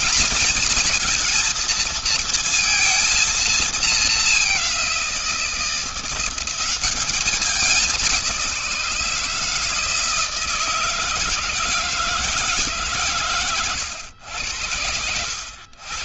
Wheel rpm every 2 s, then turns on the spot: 230, 230, 200, 180, 180, 160, 160, 90.
none